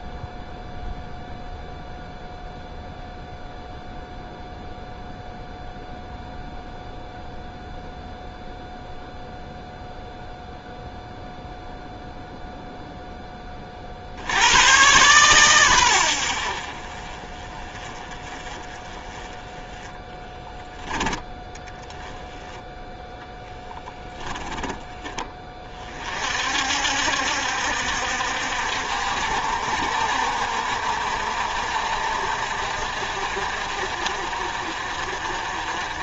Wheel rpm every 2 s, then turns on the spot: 0, 0, 0, 0, 0, 0, 0, 120, 40, 20, 10, 10, 20, 60, 60, 60, 50, 50.
none